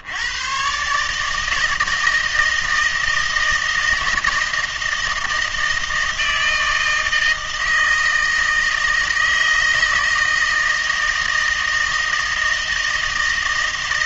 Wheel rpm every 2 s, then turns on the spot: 130, 160, 160, 160, 160, 160, 160.
none